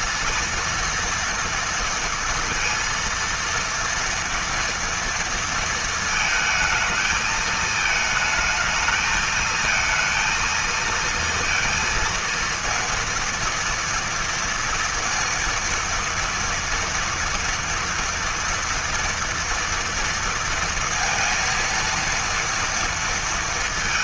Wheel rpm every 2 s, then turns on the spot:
230, 230, 230, 220, 220, 230, 230, 230, 230, 230, 230, 230.
none